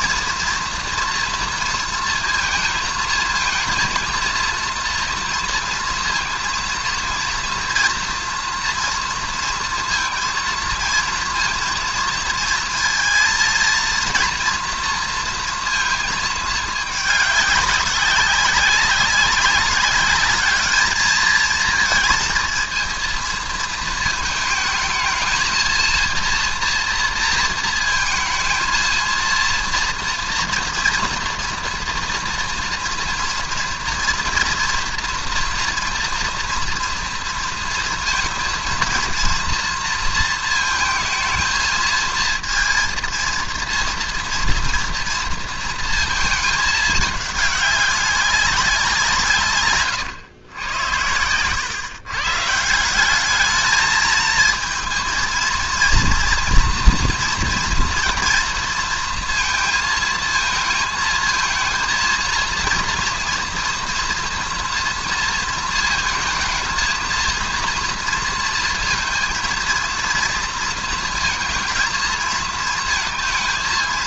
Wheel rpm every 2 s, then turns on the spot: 240, 230, 230, 230, 230, 230, 230, 240, 210, 190, 210, 230, 220, 240, 230, 230, 230, 230, 240, 230, 220, 230, 230, 220, 180, 100, 160, 220, 230, 230, 220, 230, 240, 230, 230, 230, 220.
none